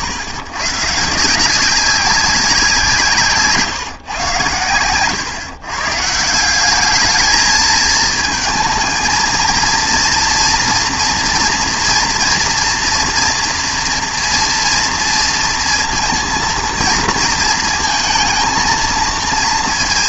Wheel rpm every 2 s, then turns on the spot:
120, 170, 110, 190, 220, 230, 240, 230, 230, 230.
none